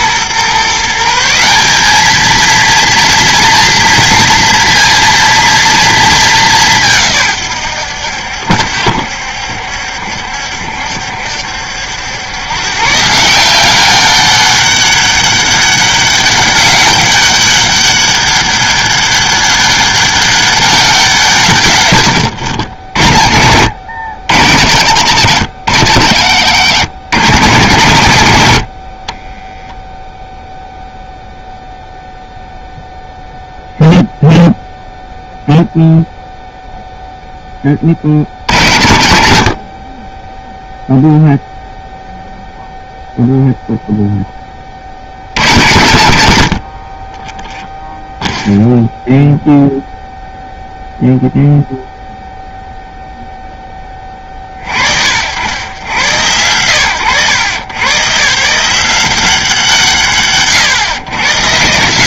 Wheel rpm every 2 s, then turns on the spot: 150, 230, 230, 170, 70, 70, 140, 200, 200, 200, 190, 70, 80, 100, 50, 0, 0, 0, 0, 80, 0, 0, 40, 60, 0, 0, 0, 40, 110, 170, 130.
none